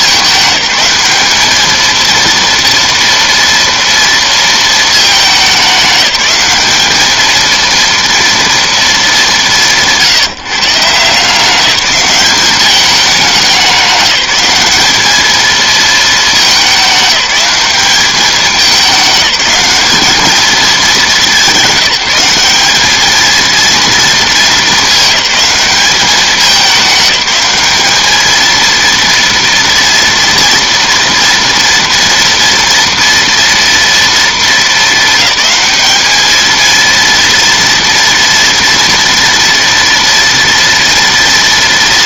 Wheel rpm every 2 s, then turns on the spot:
210, 230, 210, 220, 210, 160, 200, 210, 190, 200, 210, 220, 210, 200, 230, 230, 230, 220, 230, 230, 230.
none